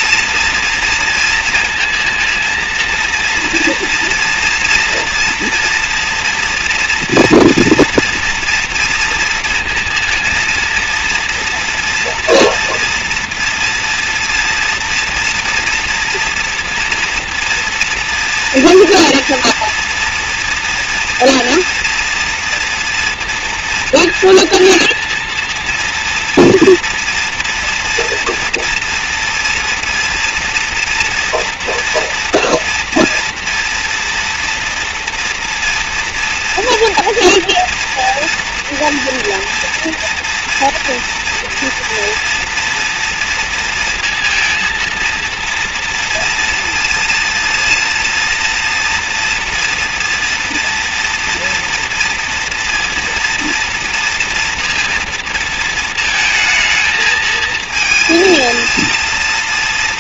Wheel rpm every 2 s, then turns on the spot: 230, 230, 230, 230, 230, 230, 240, 230, 230, 230, 230, 230, 230, 230, 230, 240, 230, 230, 230, 230, 230, 240, 230, 230, 230, 230, 230, 230, 220, 220.
none